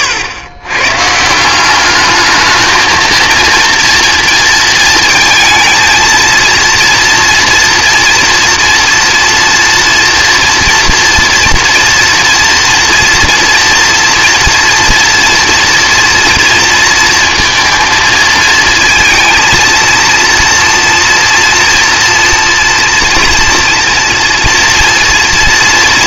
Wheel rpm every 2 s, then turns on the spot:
120, 220, 220, 230, 230, 230, 240, 230, 230, 230, 230, 230, 230.
none